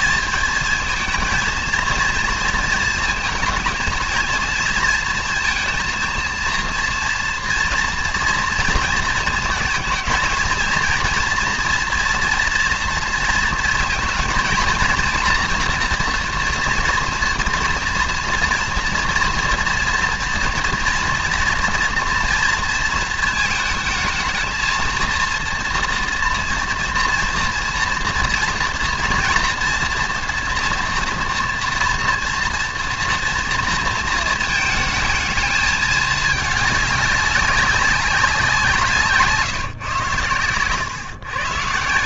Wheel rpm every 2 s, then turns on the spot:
220, 230, 230, 230, 230, 220, 230, 230, 230, 230, 230, 230, 220, 230, 230, 230, 230, 220, 210, 180, 110.
none